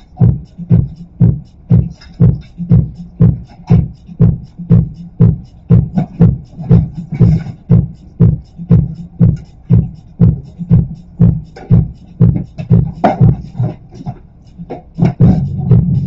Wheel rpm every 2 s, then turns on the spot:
0, 0, 0, 0, 0, 0, 0, 0.
none